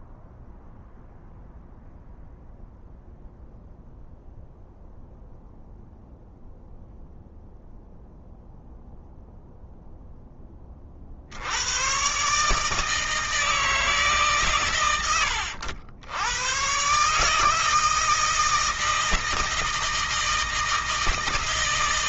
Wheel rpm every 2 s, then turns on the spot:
0, 0, 0, 0, 0, 40, 160, 110, 130, 160, 160.
none